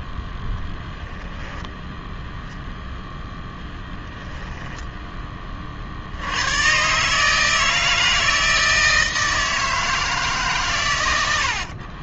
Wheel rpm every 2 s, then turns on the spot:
10, 0, 0, 100, 160, 140.
none